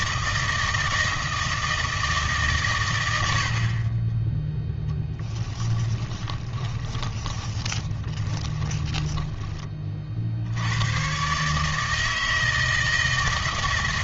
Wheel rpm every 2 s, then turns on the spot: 160, 110, 10, 20, 20, 100, 160.
4-10